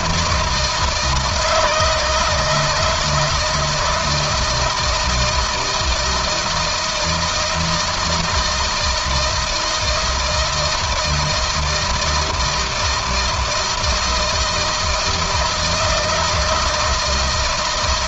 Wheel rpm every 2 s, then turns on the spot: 160, 160, 170, 160, 160, 160, 160, 160, 160.
none